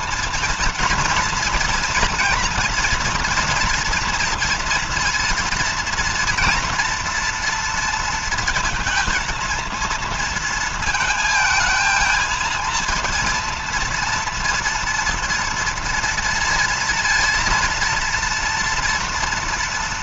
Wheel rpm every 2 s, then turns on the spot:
230, 230, 230, 240, 230, 230, 230, 230, 230, 230.
none